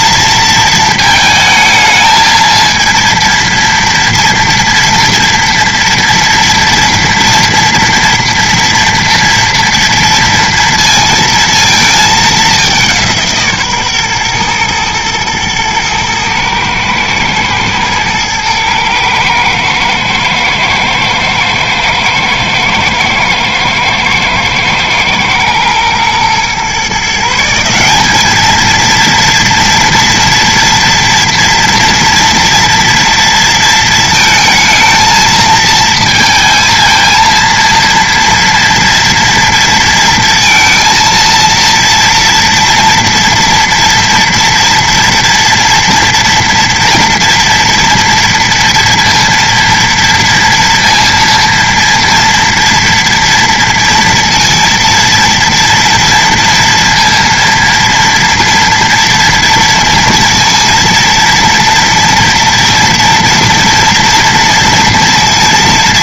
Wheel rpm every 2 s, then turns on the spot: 230, 230, 230, 230, 230, 230, 200, 120, 110, 110, 110, 110, 110, 120, 220, 230, 230, 220, 220, 230, 230, 230, 240, 230, 230, 230, 230, 230, 230, 230, 230, 230, 230.
none